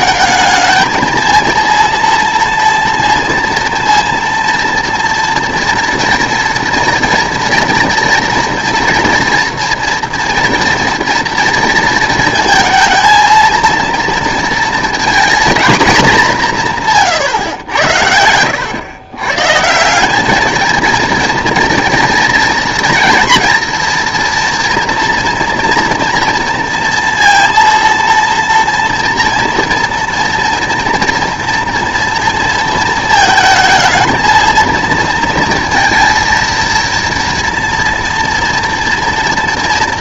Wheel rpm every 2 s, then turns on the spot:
210, 230, 230, 230, 240, 230, 230, 230, 170, 100, 220, 230, 230, 230, 230, 240, 220, 230, 230, 230.
none